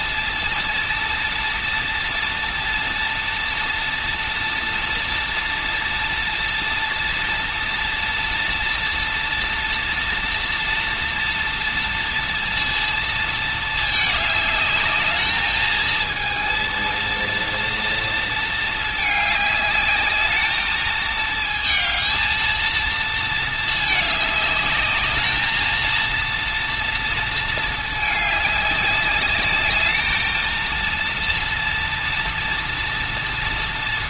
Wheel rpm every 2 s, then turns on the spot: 230, 230, 230, 230, 240, 230, 230, 210, 230, 220, 220, 230, 210, 230, 200, 230, 230.
none